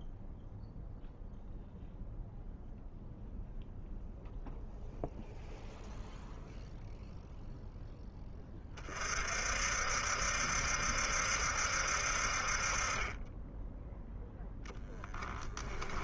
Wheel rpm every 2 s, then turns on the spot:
0, 0, 0, 0, 30, 70, 30, 10.
none